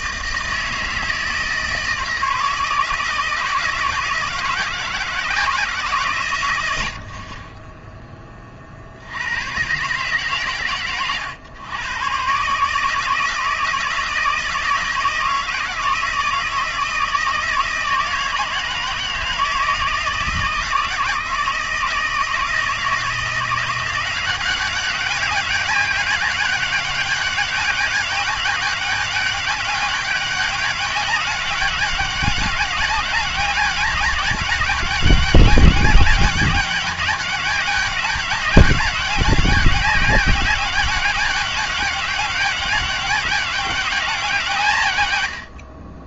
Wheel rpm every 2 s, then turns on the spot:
160, 160, 160, 70, 50, 120, 150, 160, 160, 160, 160, 160, 190, 200, 200, 200, 200, 190, 200, 200, 200, 200, 140.
none